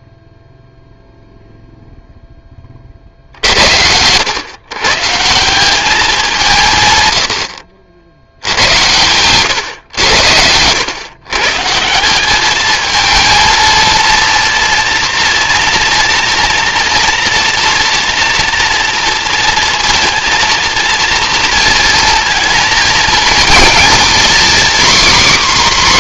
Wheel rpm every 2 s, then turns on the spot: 0, 40, 130, 140, 100, 110, 220, 230, 230, 230, 230, 230, 270.
none